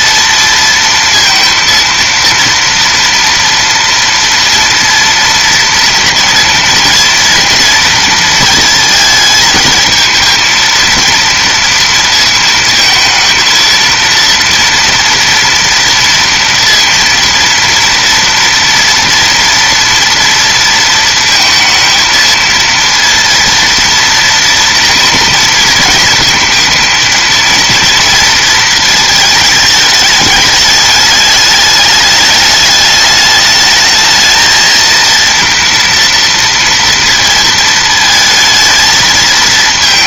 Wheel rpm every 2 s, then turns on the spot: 230, 230, 230, 230, 220, 230, 230, 230, 230, 230, 230, 230, 230, 230, 230, 210, 210, 230, 230, 230.
none